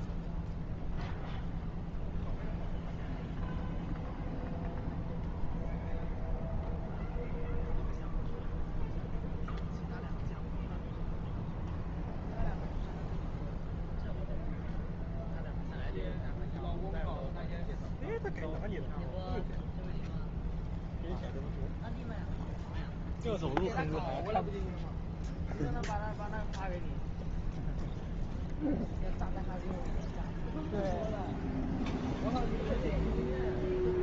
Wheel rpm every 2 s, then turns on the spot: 0, 0, 0, 0, 0, 0, 0, 0, 0, 0, 0, 0, 0, 0, 0, 0, 0.
none